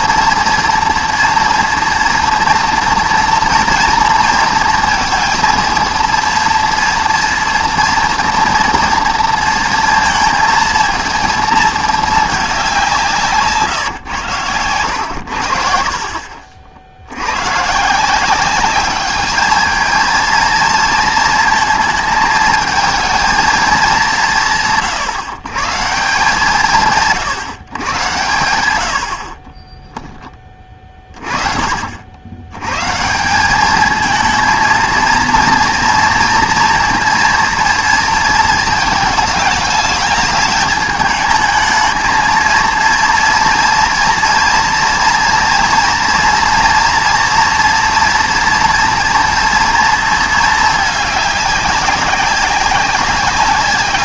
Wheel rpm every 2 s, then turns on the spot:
230, 230, 230, 230, 230, 230, 190, 100, 70, 200, 230, 220, 140, 160, 100, 30, 120, 230, 230, 220, 210, 230, 230, 230, 230, 220, 190.
none